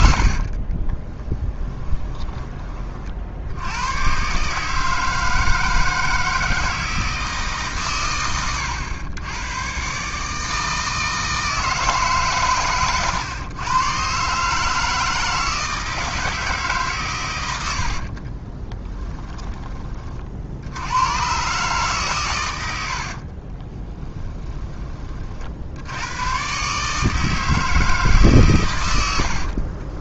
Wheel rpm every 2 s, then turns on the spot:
40, 30, 150, 160, 100, 160, 130, 160, 140, 20, 90, 80, 20, 140, 110.
0-2 18-20 22-24